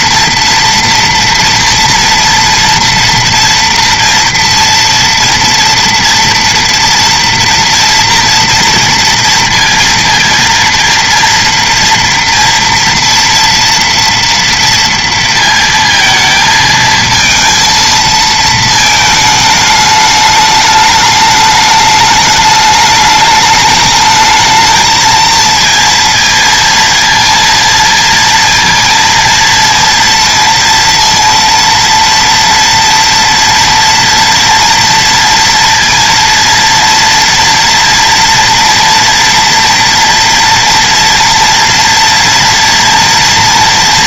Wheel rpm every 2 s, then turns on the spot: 230, 230, 230, 230, 230, 230, 230, 230, 220, 220, 210, 210, 220, 230, 230, 230, 230, 230, 230, 230, 230, 230.
none